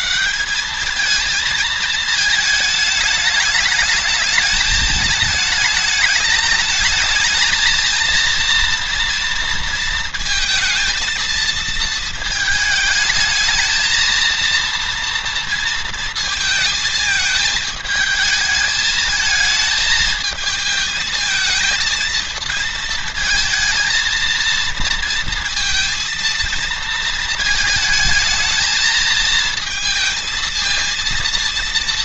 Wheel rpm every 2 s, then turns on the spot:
190, 220, 210, 210, 230, 220, 220, 230, 220, 220, 220, 230, 230, 220, 220, 230.
none